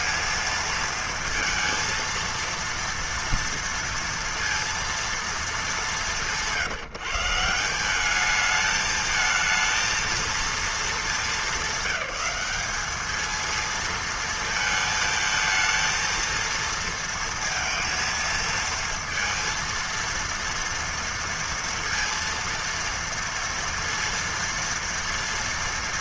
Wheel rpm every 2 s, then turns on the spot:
220, 230, 230, 160, 220, 210, 210, 220, 230, 230, 230, 230, 230.
none